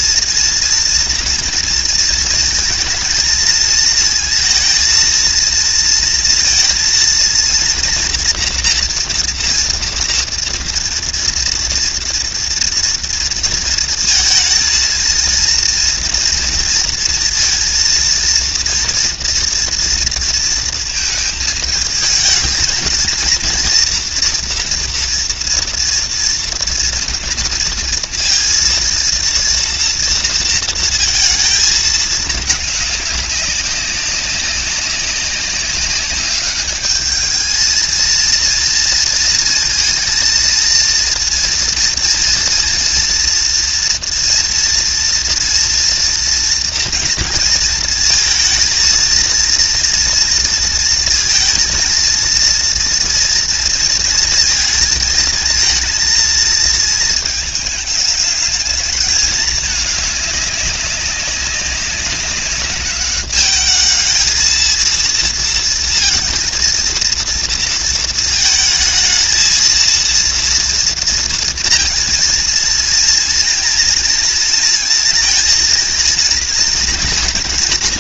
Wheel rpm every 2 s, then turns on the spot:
230, 230, 230, 230, 230, 230, 230, 230, 230, 230, 230, 230, 230, 230, 230, 230, 210, 200, 200, 230, 230, 230, 230, 230, 230, 230, 230, 220, 230, 220, 200, 200, 220, 230, 220, 230, 230, 230, 230.
none